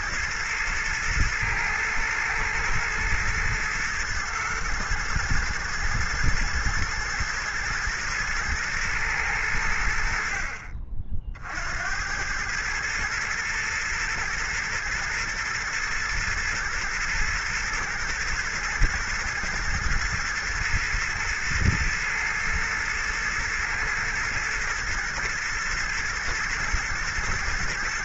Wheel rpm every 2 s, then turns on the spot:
110, 110, 110, 110, 110, 50, 110, 120, 120, 110, 110, 120, 120, 110.
none